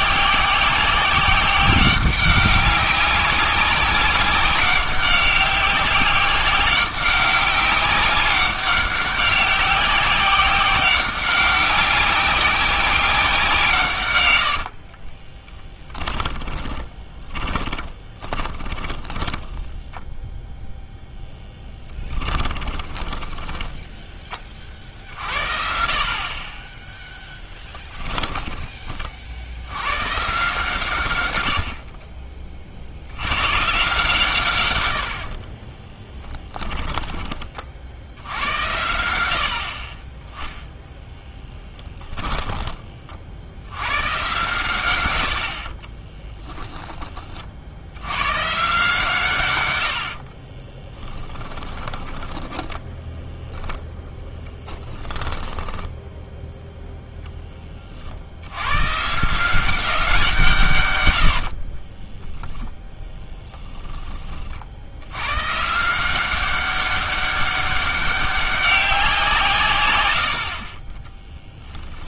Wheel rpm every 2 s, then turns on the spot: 190, 190, 190, 190, 190, 190, 190, 80, 20, 10, 0, 20, 40, 20, 20, 130, 40, 100, 20, 80, 0, 20, 120, 10, 140, 20, 10, 10, 0, 100, 140, 10, 50, 190, 190, 40.
14-20 22-24 36-38 50-56 62-64 70-72